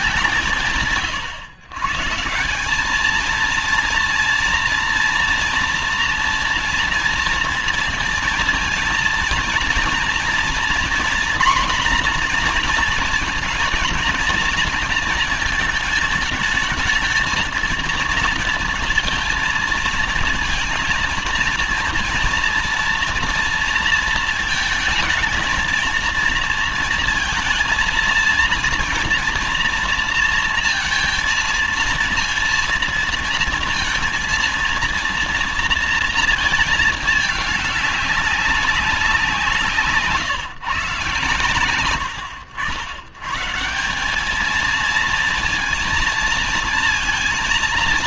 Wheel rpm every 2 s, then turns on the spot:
140, 180, 230, 230, 230, 230, 230, 220, 210, 230, 230, 230, 220, 230, 230, 230, 230, 230, 230, 190, 150, 80, 200, 230.
none